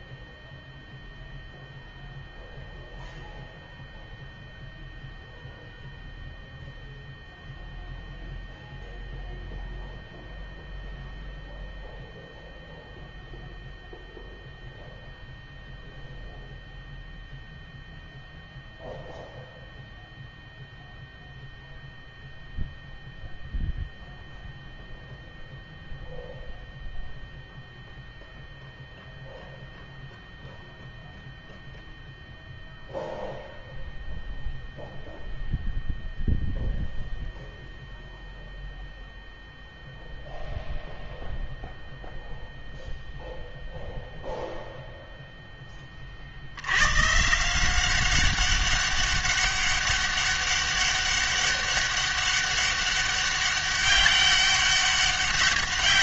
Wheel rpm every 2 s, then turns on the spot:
0, 0, 0, 0, 0, 0, 0, 0, 0, 0, 0, 0, 0, 0, 0, 0, 0, 0, 0, 0, 0, 0, 0, 80, 200, 200, 200, 200.
none